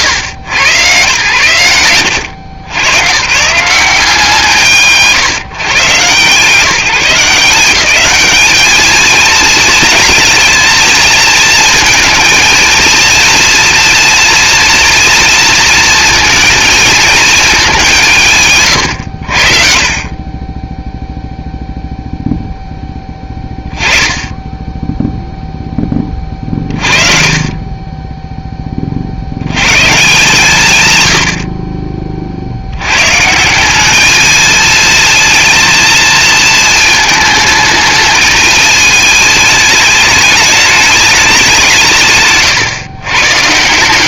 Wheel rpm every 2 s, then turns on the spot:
120, 120, 130, 160, 210, 220, 230, 240, 230, 110, 0, 10, 0, 30, 40, 160, 110, 230, 220, 210, 210, 140.
26-28